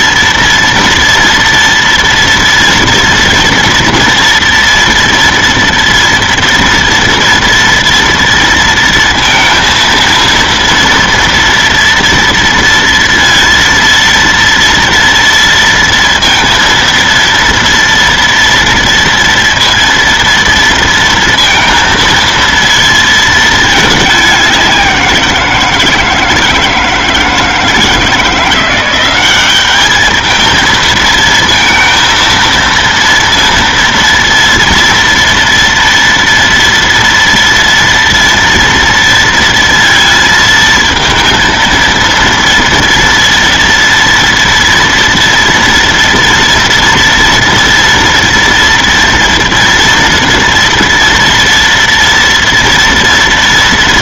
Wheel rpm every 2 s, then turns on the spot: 230, 230, 240, 230, 230, 230, 230, 230, 230, 240, 230, 230, 190, 160, 180, 220, 230, 230, 230, 230, 230, 230, 230, 230, 240, 230, 240.
none